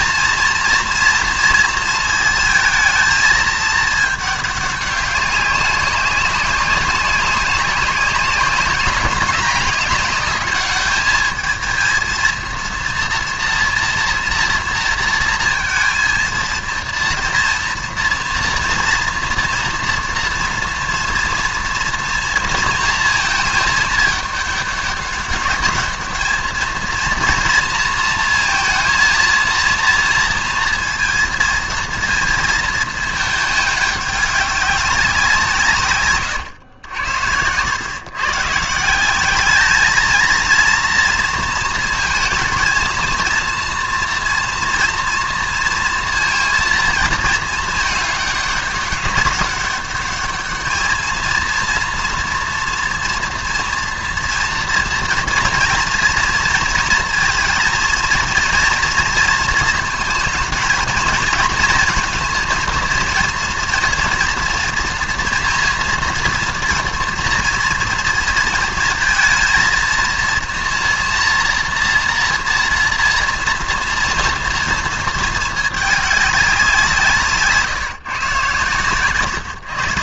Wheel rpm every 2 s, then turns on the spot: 230, 220, 210, 200, 200, 210, 230, 230, 230, 230, 230, 230, 210, 220, 230, 230, 220, 200, 110, 150, 230, 230, 240, 230, 200, 220, 230, 230, 230, 230, 220, 230, 230, 230, 230, 230, 230, 230, 190, 130.
none